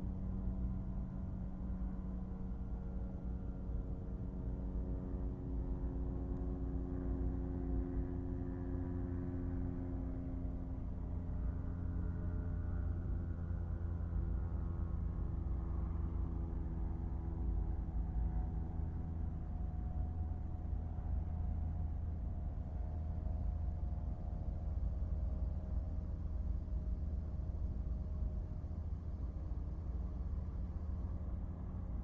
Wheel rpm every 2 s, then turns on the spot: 0, 0, 0, 0, 0, 0, 0, 0, 0, 0, 0, 0, 0, 0, 0, 0.
none